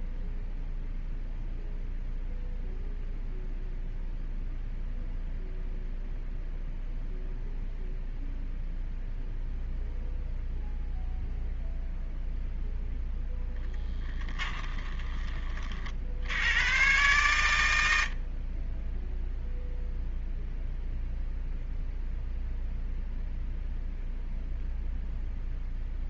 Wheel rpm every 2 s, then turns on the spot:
0, 0, 0, 0, 0, 0, 0, 20, 110, 10, 0, 0, 0.
none